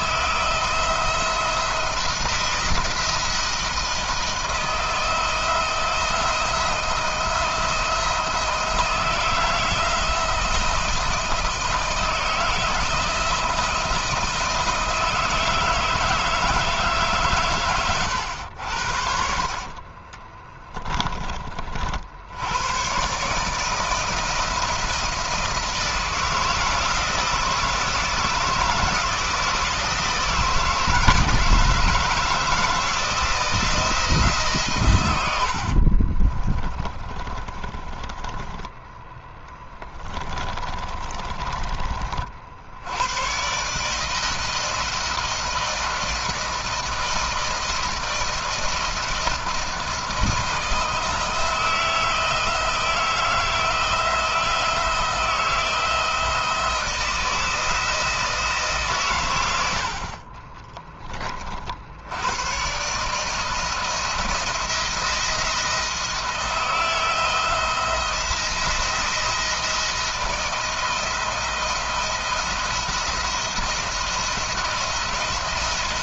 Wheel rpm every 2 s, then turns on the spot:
170, 170, 170, 170, 170, 170, 160, 160, 150, 50, 30, 120, 160, 160, 160, 160, 160, 120, 20, 20, 30, 90, 160, 160, 160, 160, 160, 160, 160, 140, 30, 140, 170, 170, 170, 170, 170, 170.
20-22 36-38 40-42